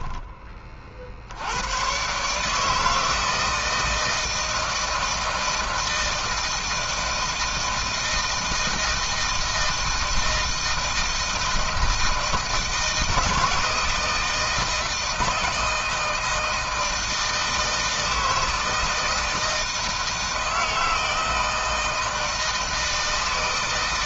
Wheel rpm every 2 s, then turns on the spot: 30, 150, 160, 160, 160, 170, 160, 160, 160, 160, 160, 160.
none